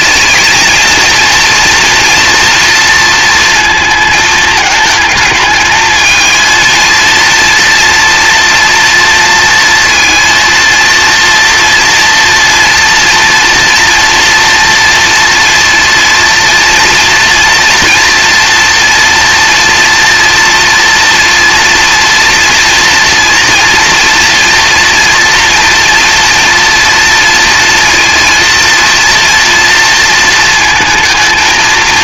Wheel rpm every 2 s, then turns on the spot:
230, 230, 220, 220, 230, 230, 230, 230, 230, 230, 230, 230, 230, 230, 230, 230.
none